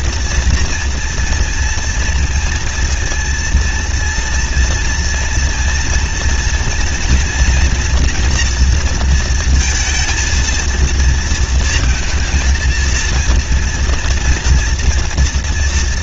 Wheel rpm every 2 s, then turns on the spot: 230, 230, 230, 240, 240, 230, 230, 230.
none